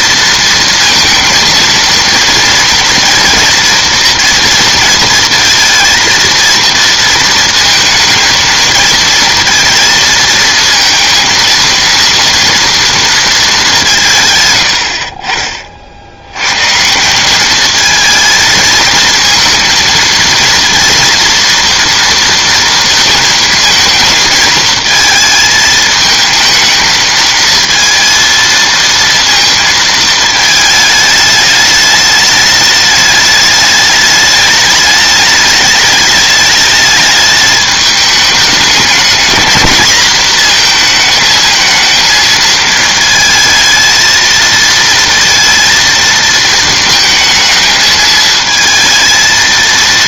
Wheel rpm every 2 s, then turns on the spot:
230, 230, 230, 230, 220, 230, 230, 100, 130, 220, 230, 230, 220, 220, 230, 220, 210, 210, 210, 210, 230, 220, 220, 220, 220.
none